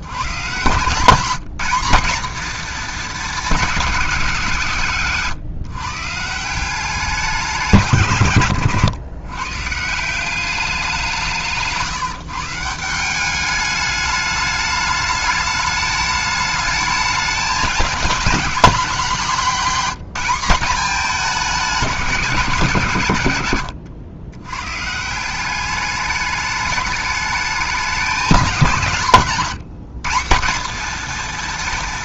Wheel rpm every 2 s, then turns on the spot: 170, 230, 140, 180, 120, 180, 170, 210, 210, 200, 200, 150, 140, 210, 170, 210.
none